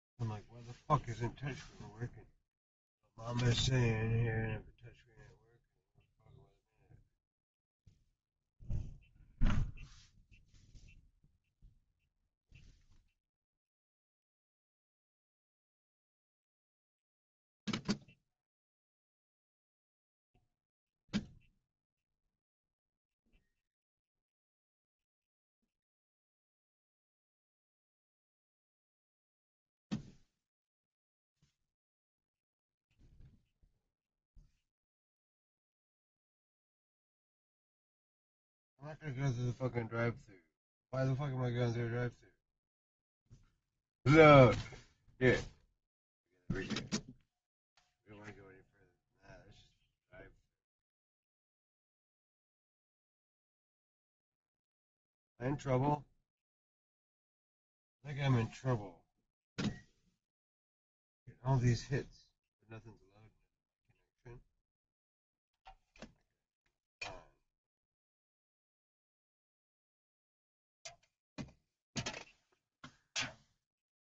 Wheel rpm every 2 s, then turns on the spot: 0, 0, 0, 0, 0, 0, 0, 0, 0, 0, 0, 0, 0, 0, 0, 0, 0, 0, 0, 0, 0, 0, 0, 0, 0, 0, 0, 0, 0, 0, 0, 0, 0, 0, 0, 0, 0.
none